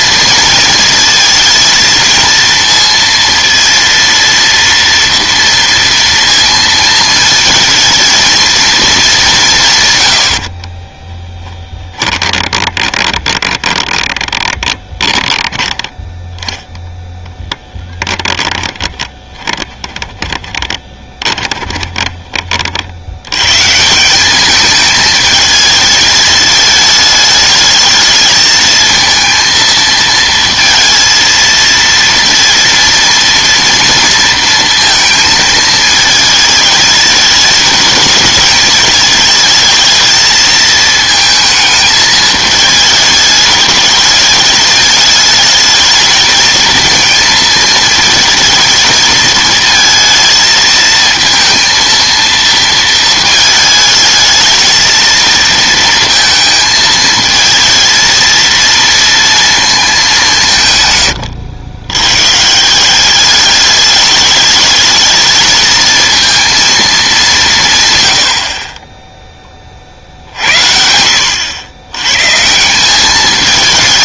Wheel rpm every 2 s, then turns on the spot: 230, 230, 230, 230, 220, 40, 20, 20, 0, 10, 20, 60, 210, 220, 220, 230, 230, 230, 220, 220, 220, 220, 220, 230, 220, 220, 220, 220, 220, 230, 140, 170, 210, 230, 20, 70, 170.
10-16 18-22